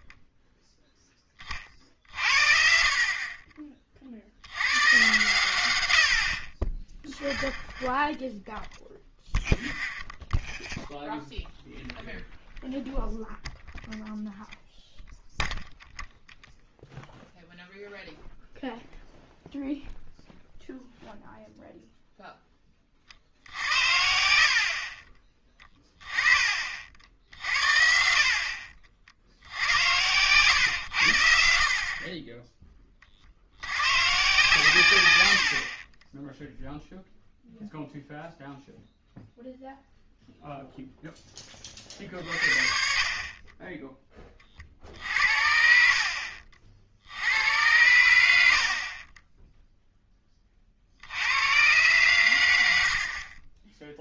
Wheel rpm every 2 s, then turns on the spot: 0, 50, 100, 30, 0, 0, 0, 0, 0, 0, 0, 10, 60, 40, 60, 110, 30, 130, 0, 0, 0, 40, 40, 60, 60, 40, 90.
none